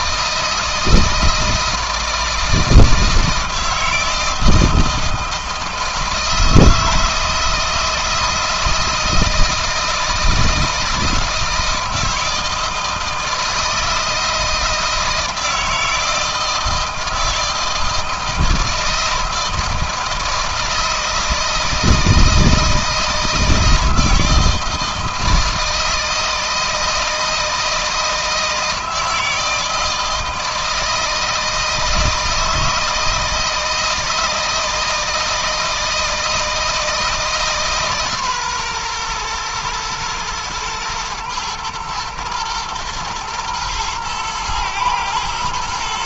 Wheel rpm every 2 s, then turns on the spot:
160, 160, 160, 160, 160, 160, 160, 160, 160, 160, 160, 160, 160, 160, 160, 160, 160, 160, 160, 120, 110, 120, 120.
none